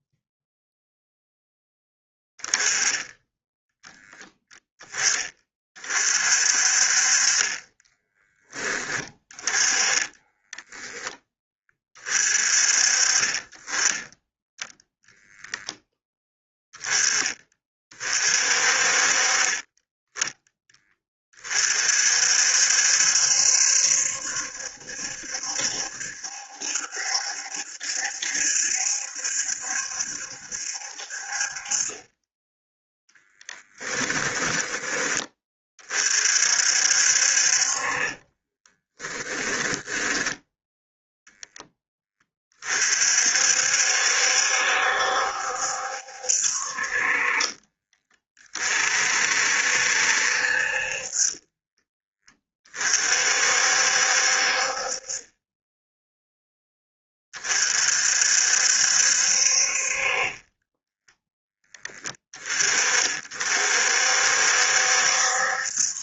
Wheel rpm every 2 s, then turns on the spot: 10, 20, 10, 40, 20, 10, 30, 0, 10, 40, 20, 70, 70, 70, 70, 60, 10, 20, 60, 10, 0, 50, 70, 40, 50, 50, 40, 40, 20, 60, 10, 40, 70.
38-40 50-52 60-62